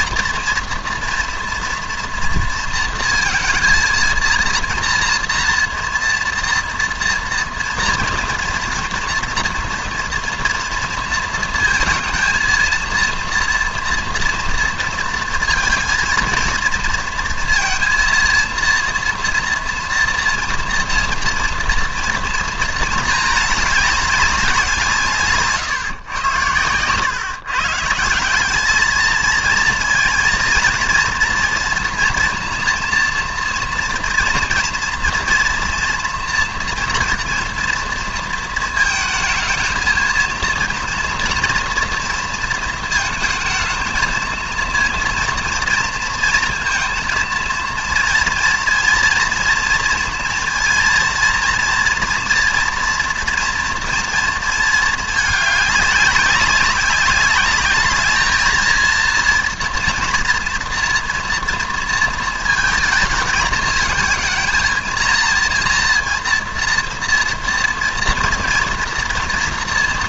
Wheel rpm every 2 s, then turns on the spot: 230, 230, 230, 230, 230, 230, 230, 230, 230, 230, 230, 230, 180, 110, 210, 230, 230, 230, 240, 220, 230, 220, 230, 230, 230, 230, 230, 220, 200, 220, 240, 220, 220, 230, 230.
none